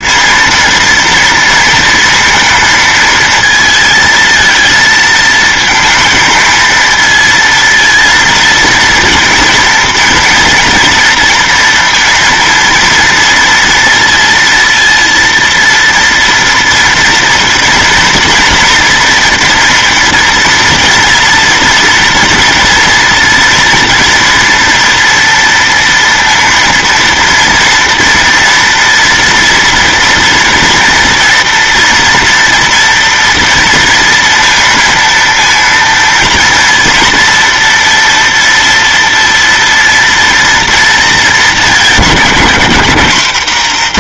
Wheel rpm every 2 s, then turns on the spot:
230, 230, 230, 230, 230, 230, 230, 230, 230, 230, 230, 230, 230, 230, 230, 230, 240, 230, 230, 230, 230, 200.
none